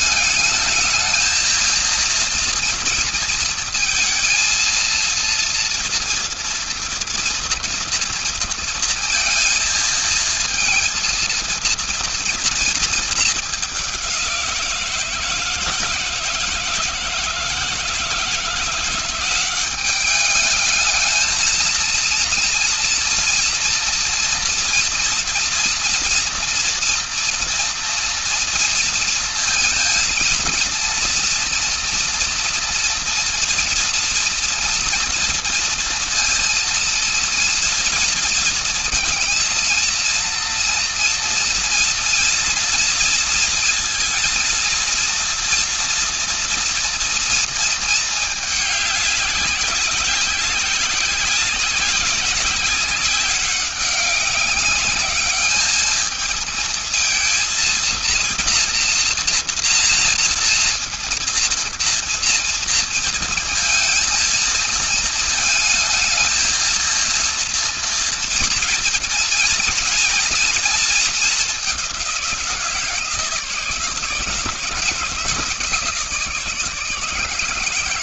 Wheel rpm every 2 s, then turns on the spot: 220, 230, 230, 230, 230, 230, 210, 160, 160, 180, 220, 230, 240, 240, 230, 230, 230, 230, 230, 230, 230, 230, 230, 230, 200, 190, 190, 210, 230, 230, 230, 230, 220, 230, 230, 210, 160, 160, 160.
none